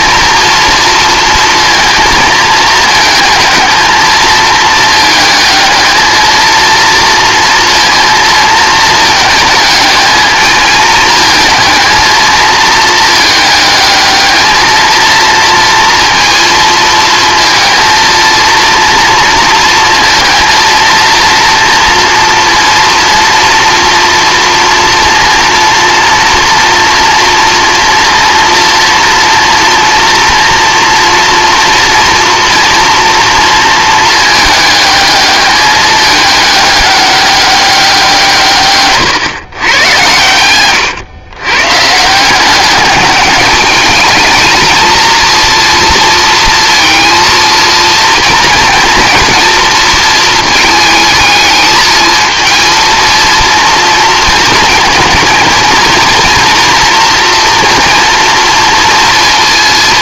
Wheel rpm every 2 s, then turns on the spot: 230, 220, 220, 230, 220, 220, 220, 220, 230, 230, 230, 230, 230, 230, 230, 230, 230, 210, 210, 130, 120, 200, 220, 230, 230, 220, 230, 230, 230, 230.
38-40